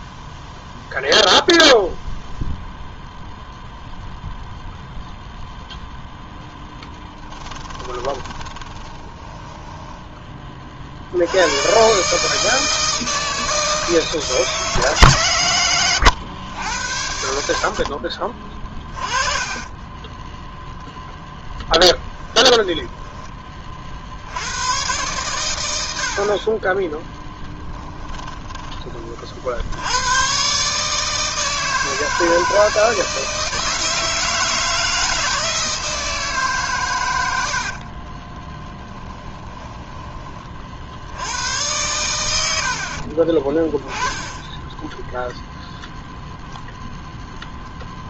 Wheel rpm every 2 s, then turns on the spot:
0, 0, 0, 10, 10, 50, 160, 140, 90, 30, 0, 20, 120, 20, 30, 150, 160, 160, 120, 10, 60, 50, 10, 0.
6-10 22-24 38-40